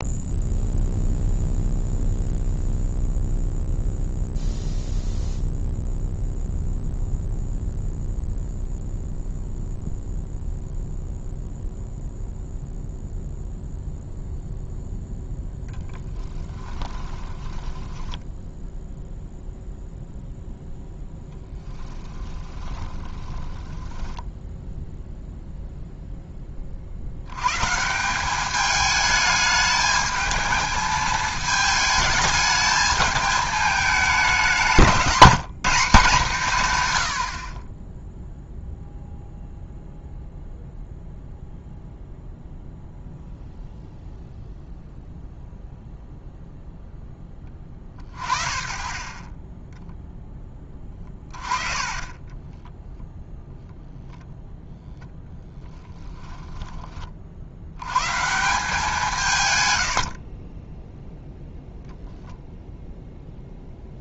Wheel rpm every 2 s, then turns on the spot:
0, 0, 0, 0, 0, 0, 0, 0, 10, 0, 0, 10, 0, 60, 210, 220, 220, 190, 120, 0, 0, 0, 0, 0, 30, 20, 10, 0, 20, 170, 0, 0.
16-18 22-24